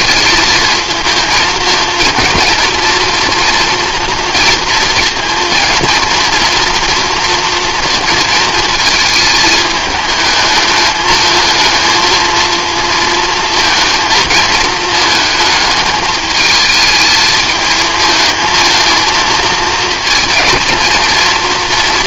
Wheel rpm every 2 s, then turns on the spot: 220, 230, 230, 230, 220, 210, 230, 220, 220, 220, 220.
none